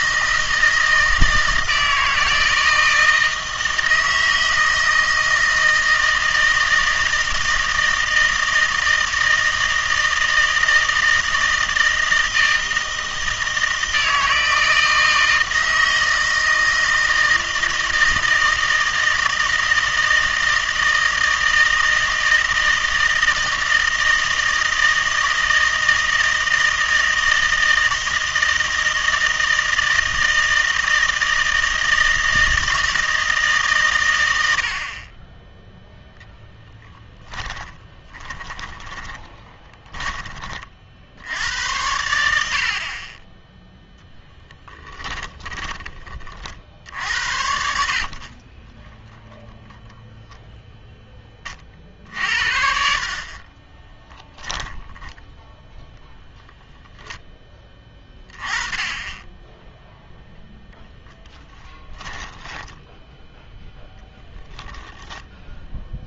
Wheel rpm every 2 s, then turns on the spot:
160, 160, 160, 160, 160, 160, 160, 160, 160, 160, 160, 160, 160, 160, 160, 160, 160, 90, 0, 20, 40, 70, 10, 50, 20, 0, 60, 10, 0, 20, 0, 10, 0.
38-40 44-46 48-50 62-64